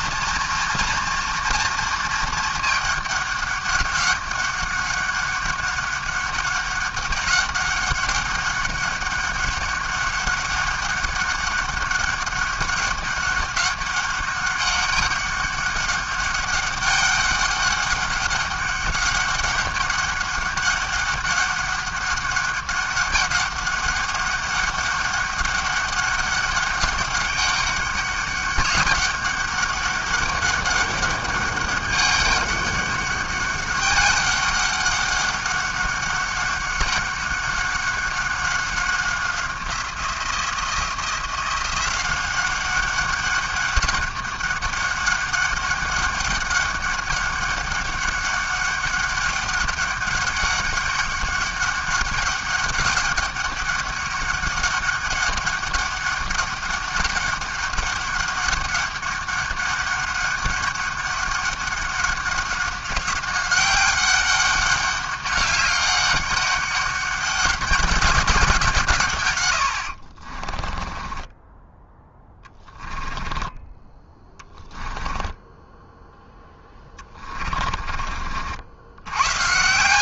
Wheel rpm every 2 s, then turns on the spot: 240, 220, 200, 200, 200, 200, 200, 200, 200, 200, 200, 200, 200, 200, 200, 200, 200, 200, 200, 190, 170, 190, 200, 200, 200, 200, 200, 200, 200, 200, 200, 190, 200, 200, 170, 30, 10, 20, 10, 50.
70-78